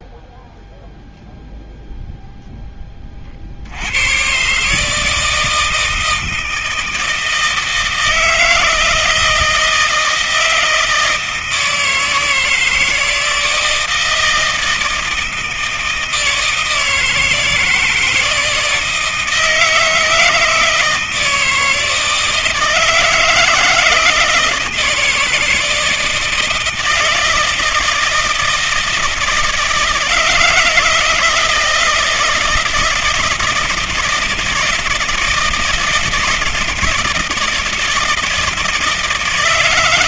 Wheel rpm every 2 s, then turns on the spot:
0, 0, 130, 160, 160, 160, 160, 160, 160, 160, 160, 160, 170, 160, 160, 160, 160, 160, 160, 160.
none